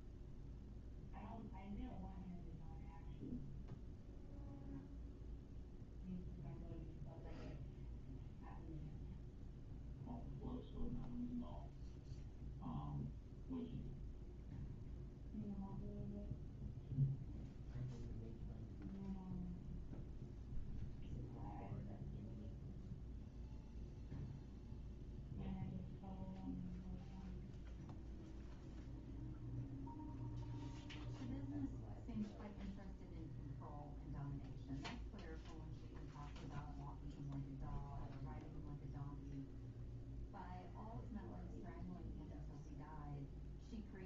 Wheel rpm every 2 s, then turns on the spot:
0, 0, 0, 0, 0, 0, 0, 0, 0, 0, 0, 0, 0, 0, 0, 0, 0, 0, 0, 0, 0, 0.
none